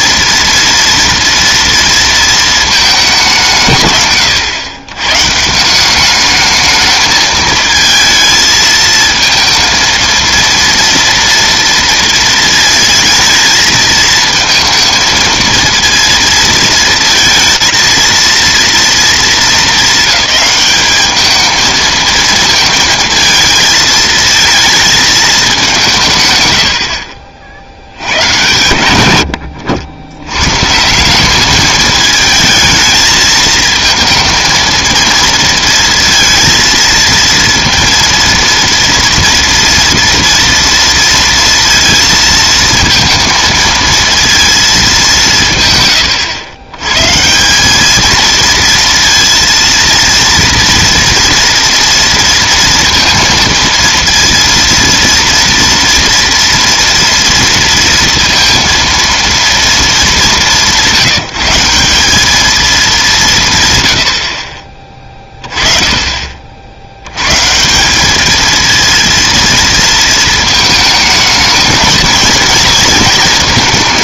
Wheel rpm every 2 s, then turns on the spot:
230, 220, 100, 220, 220, 230, 220, 230, 230, 230, 210, 220, 220, 100, 110, 140, 220, 230, 230, 230, 230, 230, 220, 100, 230, 230, 230, 230, 230, 230, 190, 220, 20, 50, 220, 220, 230.
none